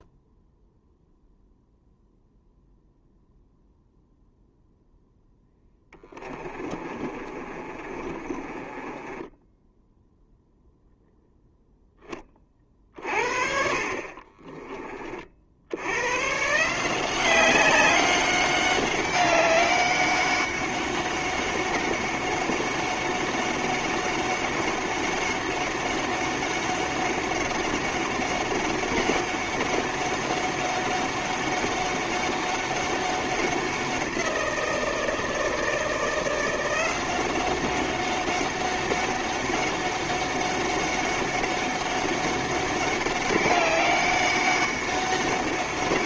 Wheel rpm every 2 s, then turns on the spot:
0, 0, 0, 30, 20, 0, 40, 30, 170, 200, 200, 200, 200, 200, 200, 200, 190, 170, 180, 190, 200, 200, 200.
6-10